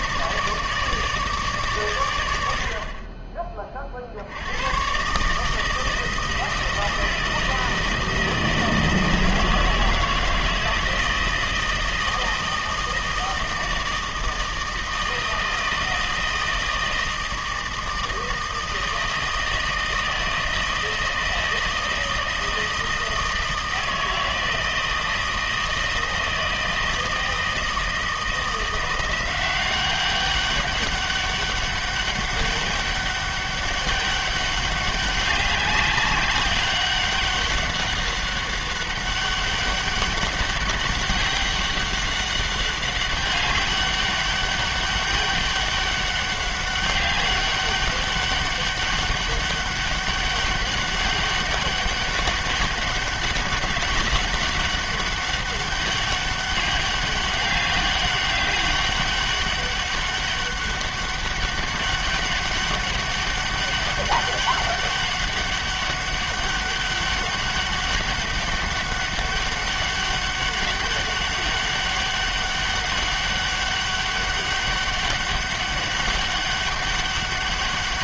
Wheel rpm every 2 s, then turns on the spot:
150, 50, 110, 160, 160, 160, 160, 160, 160, 160, 160, 160, 160, 160, 170, 200, 200, 200, 190, 200, 200, 200, 200, 200, 200, 200, 200, 200, 200, 200, 200, 200, 200, 200, 200, 200, 200, 200, 200.
none